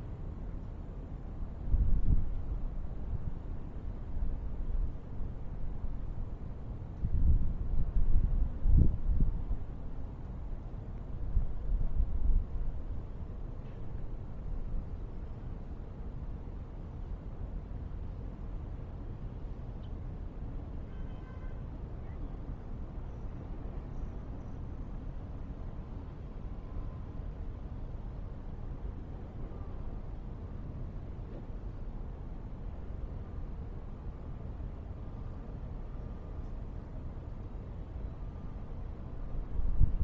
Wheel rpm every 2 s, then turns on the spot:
0, 0, 0, 0, 0, 0, 0, 0, 0, 0, 0, 0, 0, 0, 0, 0, 0, 0, 0, 0.
none